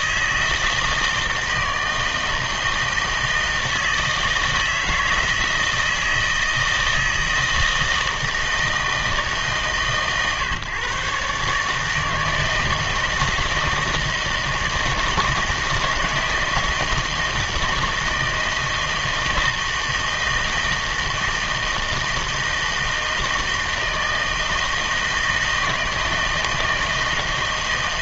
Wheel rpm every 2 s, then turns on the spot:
160, 160, 160, 160, 160, 130, 160, 160, 160, 160, 160, 160, 160, 160.
none